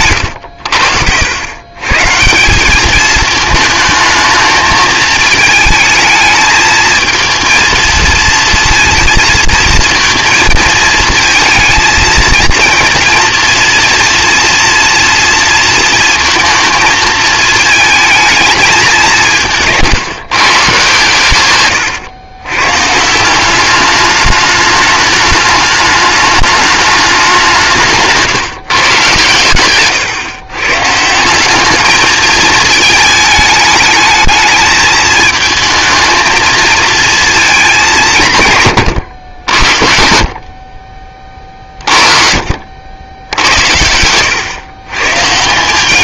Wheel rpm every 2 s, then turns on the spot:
80, 200, 220, 220, 230, 220, 230, 240, 220, 210, 140, 140, 210, 210, 140, 140, 220, 220, 230, 130, 50, 60, 120.
none